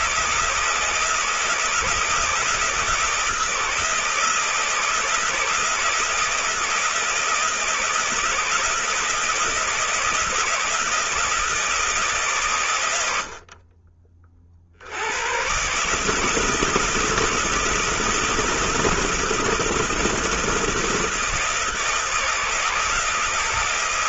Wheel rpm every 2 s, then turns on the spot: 160, 160, 160, 160, 160, 160, 130, 60, 170, 170, 160, 160.
none